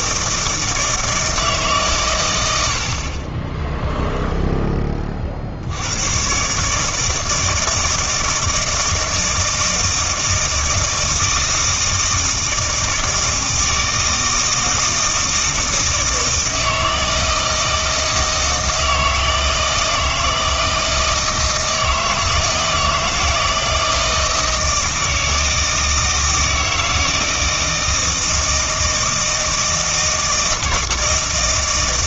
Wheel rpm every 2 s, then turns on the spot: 160, 70, 20, 150, 160, 160, 160, 160, 160, 160, 160, 160, 160, 160, 160, 160.
none